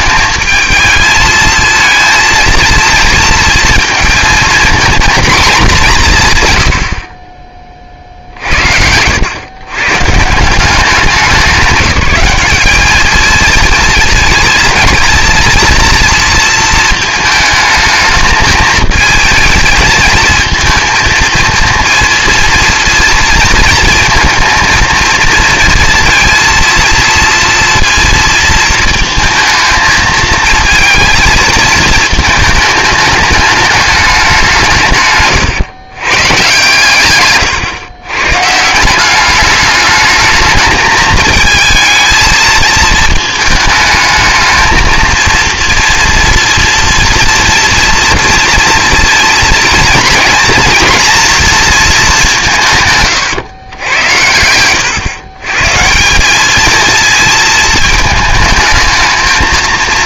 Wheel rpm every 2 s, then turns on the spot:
220, 230, 230, 80, 80, 190, 210, 230, 220, 220, 220, 230, 230, 230, 220, 230, 220, 150, 130, 170, 220, 220, 220, 230, 230, 230, 150, 110, 220, 220.
none